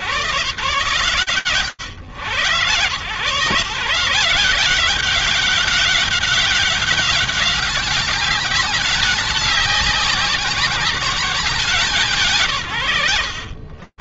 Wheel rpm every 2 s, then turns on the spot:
130, 130, 190, 200, 200, 190, 90.
none